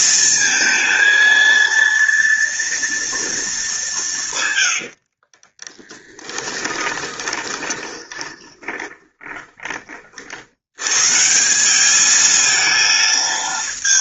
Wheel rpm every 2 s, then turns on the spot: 220, 230, 100, 20, 20, 100, 220.
4-10